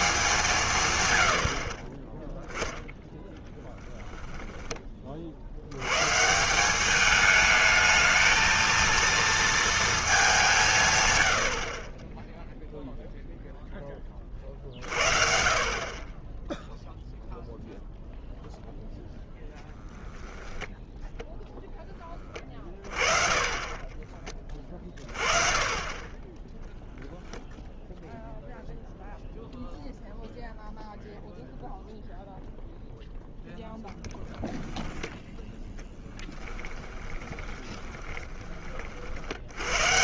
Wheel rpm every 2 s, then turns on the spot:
20, 10, 100, 220, 220, 40, 10, 30, 0, 0, 0, 30, 20, 0, 0, 0, 0, 0, 20, 80.
2-4 36-38